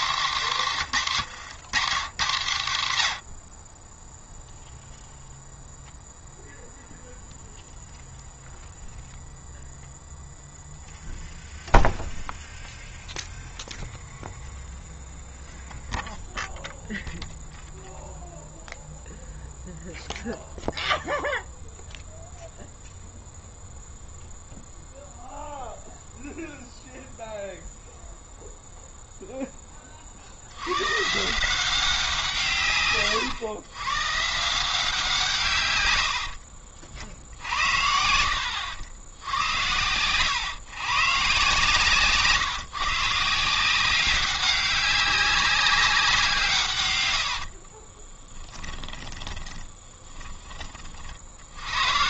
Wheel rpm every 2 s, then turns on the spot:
200, 130, 0, 0, 0, 0, 0, 0, 0, 0, 0, 0, 0, 0, 0, 100, 140, 180, 60, 90, 130, 150, 190, 130, 20, 30.
36-38 48-50